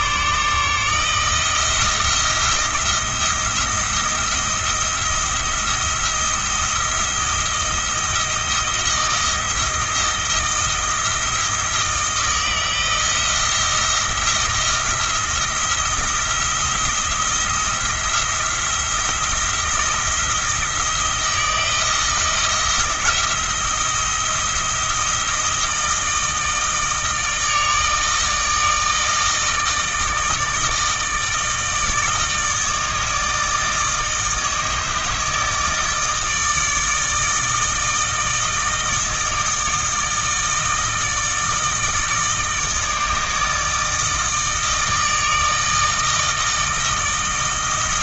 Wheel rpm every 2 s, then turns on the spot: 150, 170, 170, 170, 160, 160, 160, 170, 170, 170, 170, 160, 160, 160, 160, 160, 160, 160, 160, 160, 160, 160, 160, 160.
none